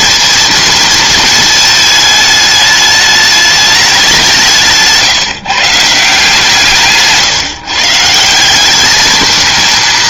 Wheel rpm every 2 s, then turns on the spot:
230, 210, 180, 160, 180.
none